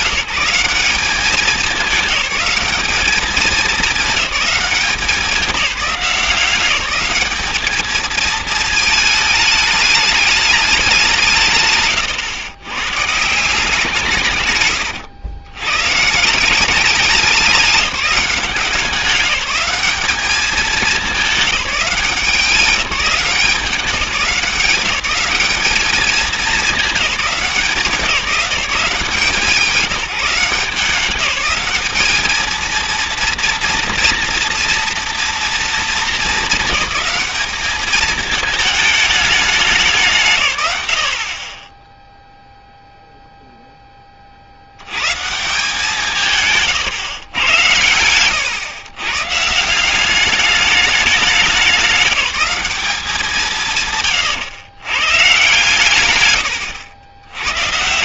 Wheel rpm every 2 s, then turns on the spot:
200, 210, 200, 190, 220, 200, 120, 130, 190, 180, 210, 190, 180, 210, 180, 170, 220, 230, 210, 210, 120, 0, 90, 150, 120, 200, 200, 110, 120.
14-16 46-48 56-58